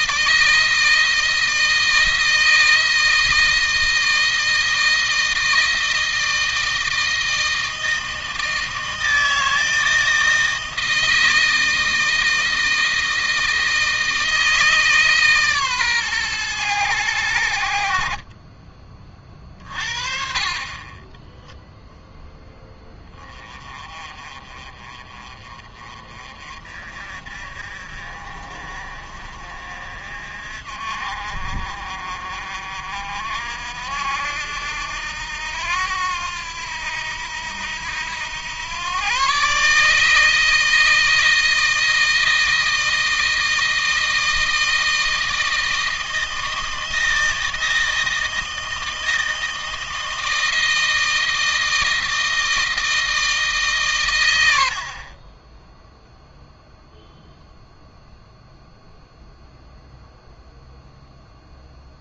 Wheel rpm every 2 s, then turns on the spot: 160, 160, 160, 160, 160, 160, 160, 150, 100, 30, 20, 10, 30, 40, 50, 50, 50, 80, 90, 110, 160, 160, 160, 160, 160, 160, 170, 60, 0, 0, 0.
20-22